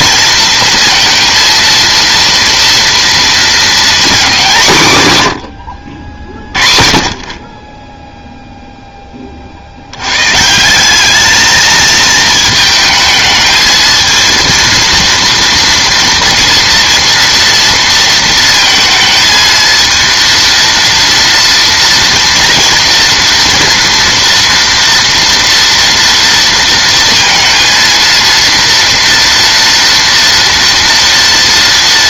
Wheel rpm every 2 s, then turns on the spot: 230, 230, 180, 40, 0, 170, 220, 230, 230, 230, 230, 230, 230, 230, 230, 230.
none